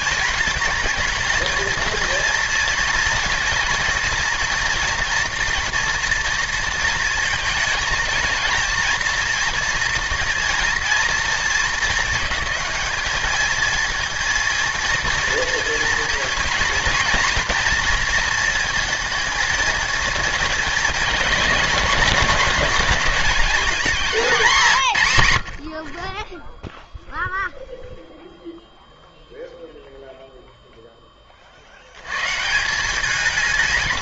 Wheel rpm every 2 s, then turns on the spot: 220, 230, 230, 230, 230, 220, 220, 230, 240, 230, 230, 210, 100, 0, 0, 10, 160.
none